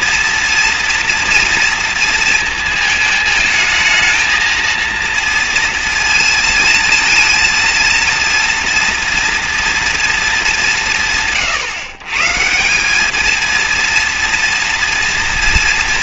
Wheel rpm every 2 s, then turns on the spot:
230, 220, 220, 230, 230, 200, 190, 240.
none